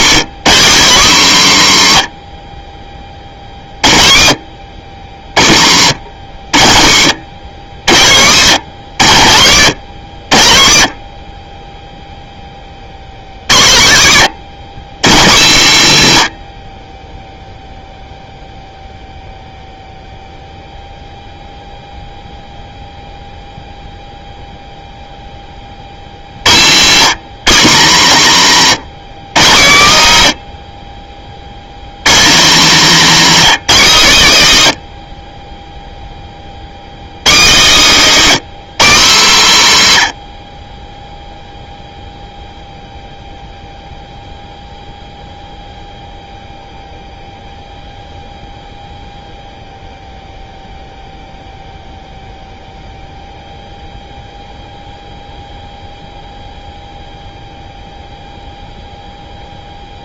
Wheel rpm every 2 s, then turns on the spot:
240, 80, 60, 100, 150, 70, 20, 150, 80, 0, 0, 0, 0, 140, 170, 70, 230, 140, 50, 240, 40, 0, 0, 0, 0, 0, 0, 0, 0, 0.
none